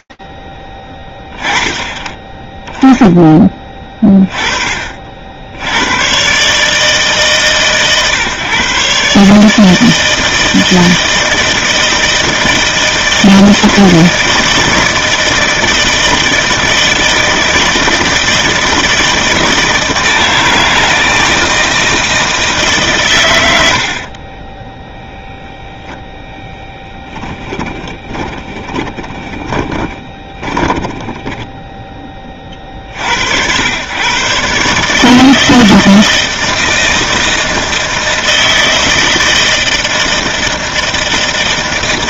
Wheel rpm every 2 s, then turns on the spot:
20, 20, 60, 140, 140, 160, 160, 160, 160, 160, 160, 110, 0, 10, 20, 10, 50, 150, 160, 160, 160.
26-32